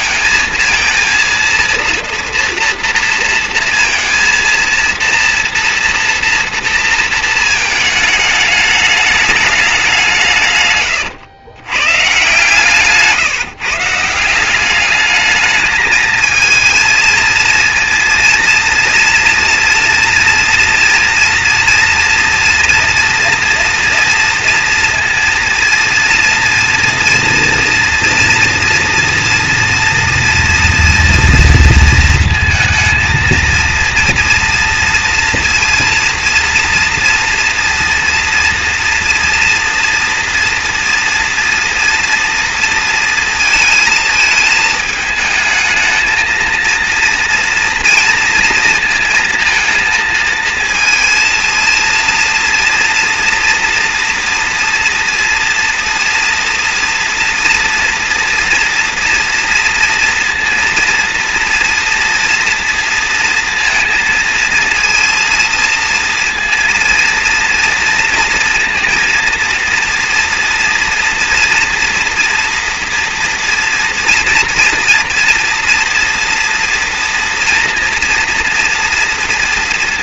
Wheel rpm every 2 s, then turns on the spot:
230, 230, 230, 230, 210, 160, 140, 170, 230, 230, 230, 240, 230, 230, 230, 230, 230, 230, 230, 240, 230, 230, 220, 220, 230, 230, 230, 230, 230, 230, 230, 230, 230, 230, 230, 230, 240, 240, 230, 230.
none